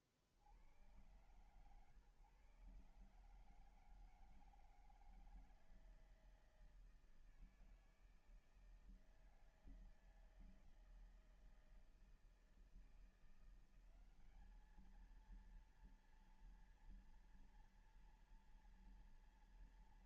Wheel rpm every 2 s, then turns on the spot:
70, 130, 160, 160, 160, 160, 160, 200, 230, 230.
none